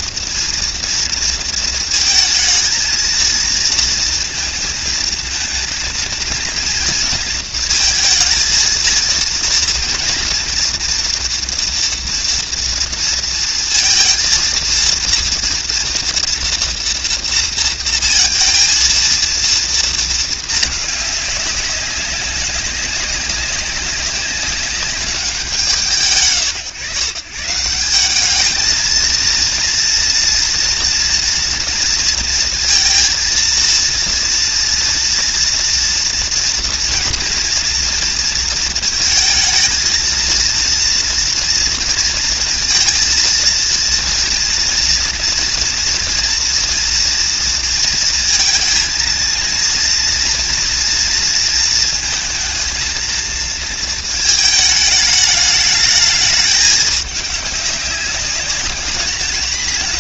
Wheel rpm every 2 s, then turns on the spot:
230, 220, 230, 230, 230, 230, 230, 230, 230, 230, 210, 200, 180, 140, 220, 230, 230, 230, 230, 230, 230, 230, 230, 230, 220, 230, 230, 210, 210, 210.
none